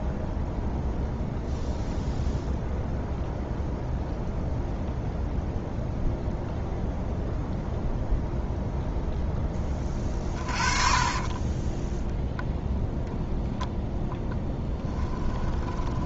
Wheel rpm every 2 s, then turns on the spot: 0, 0, 0, 0, 0, 30, 0, 10.
10-12 14-16